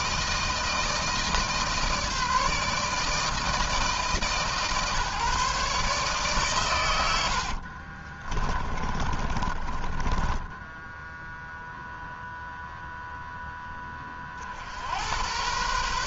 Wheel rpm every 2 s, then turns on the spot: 160, 150, 150, 100, 30, 10, 0, 70.
6-12